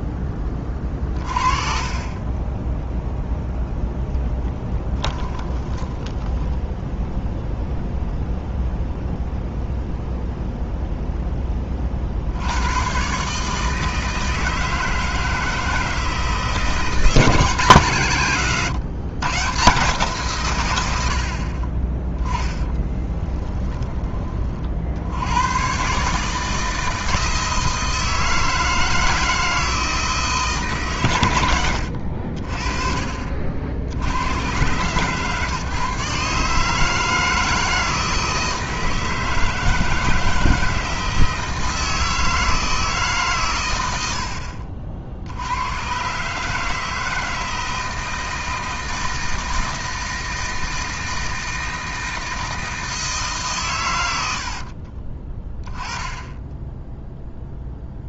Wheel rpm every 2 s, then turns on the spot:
30, 10, 10, 0, 0, 0, 110, 160, 170, 140, 100, 30, 60, 160, 160, 140, 40, 110, 150, 160, 160, 160, 50, 160, 160, 160, 160, 40, 10.
4-6 22-24 54-56